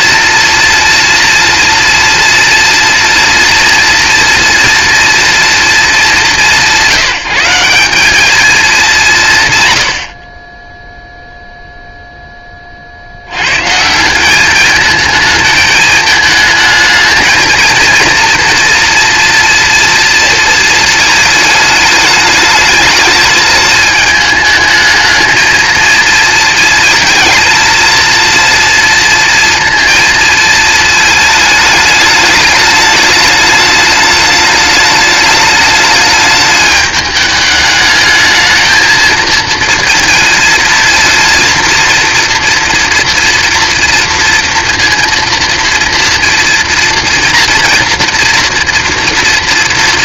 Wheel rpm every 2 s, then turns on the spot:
230, 240, 230, 160, 220, 0, 40, 210, 220, 230, 220, 220, 220, 220, 230, 220, 210, 210, 210, 220, 230, 230, 230, 230, 240.
none